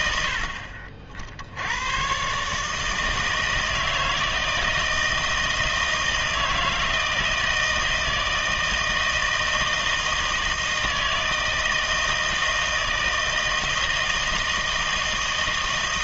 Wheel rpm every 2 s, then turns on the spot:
60, 150, 160, 160, 160, 160, 160, 160.
none